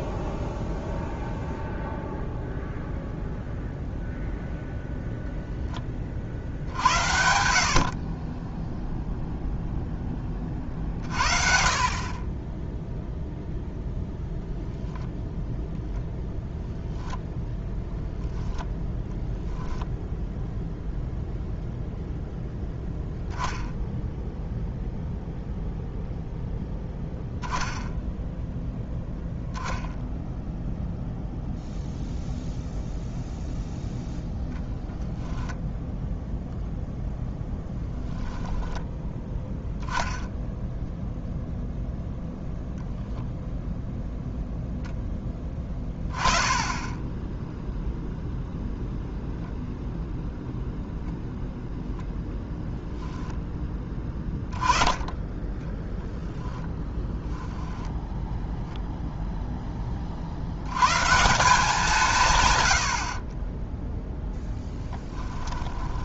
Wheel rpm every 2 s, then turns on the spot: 0, 0, 0, 70, 10, 40, 10, 0, 0, 0, 0, 0, 0, 0, 0, 0, 0, 0, 0, 10, 0, 0, 0, 10, 0, 0, 0, 10, 10, 0, 100, 100, 10.
64-66